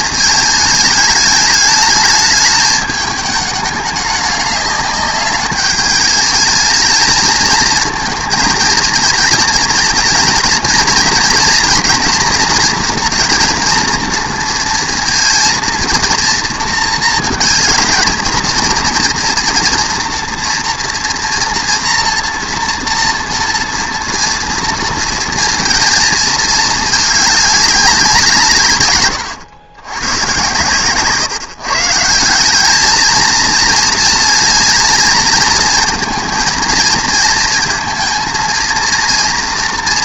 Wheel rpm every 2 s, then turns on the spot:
220, 210, 200, 220, 220, 230, 240, 230, 230, 230, 230, 230, 230, 220, 140, 130, 200, 230, 230, 230.
none